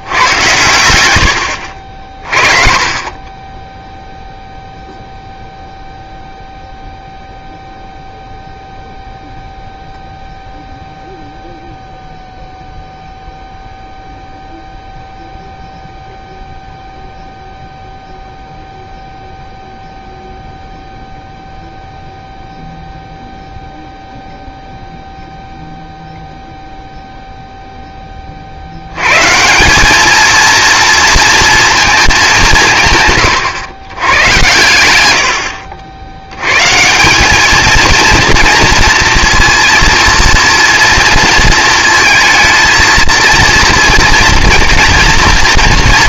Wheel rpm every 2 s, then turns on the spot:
100, 30, 0, 0, 0, 0, 0, 0, 0, 0, 0, 0, 0, 0, 80, 230, 170, 100, 150, 230, 230, 230, 230.
none